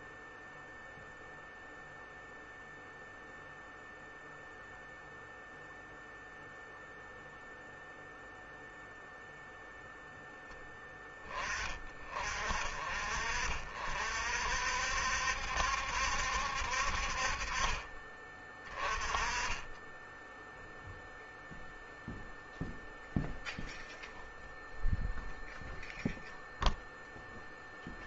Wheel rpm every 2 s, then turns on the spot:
0, 0, 0, 0, 0, 10, 40, 60, 60, 20, 0, 0, 0, 0.
none